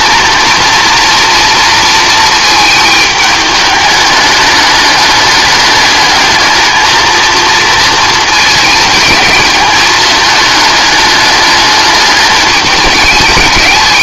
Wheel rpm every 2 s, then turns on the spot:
230, 220, 210, 220, 220, 210, 210.
none